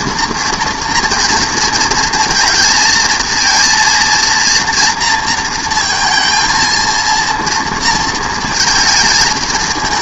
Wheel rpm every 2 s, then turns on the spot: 230, 230, 230, 230, 220.
none